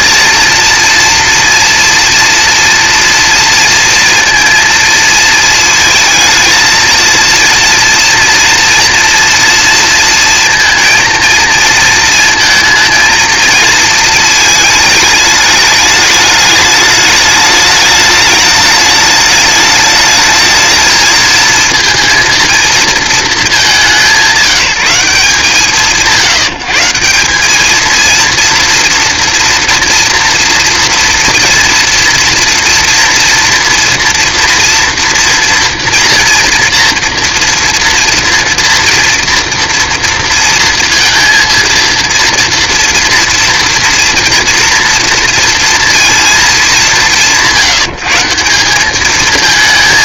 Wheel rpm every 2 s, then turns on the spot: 240, 230, 230, 220, 240, 230, 230, 210, 210, 210, 220, 230, 180, 160, 230, 230, 230, 240, 230, 230, 230, 230, 230, 200, 210.
none